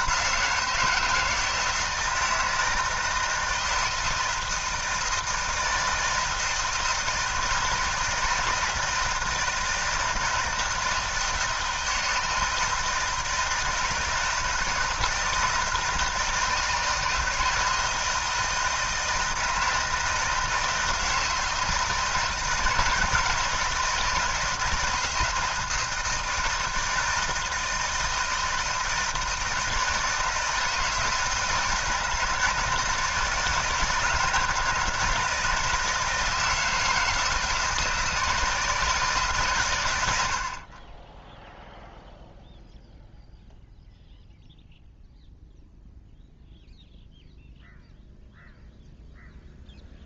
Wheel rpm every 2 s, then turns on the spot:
170, 160, 160, 160, 160, 160, 160, 160, 160, 160, 160, 160, 160, 160, 160, 160, 160, 150, 160, 160, 30, 0, 0, 0, 0.
none